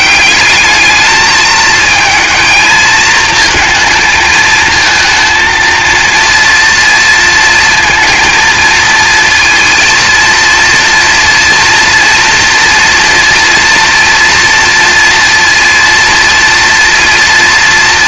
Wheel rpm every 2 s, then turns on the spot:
210, 230, 230, 230, 230, 230, 230, 230, 240.
none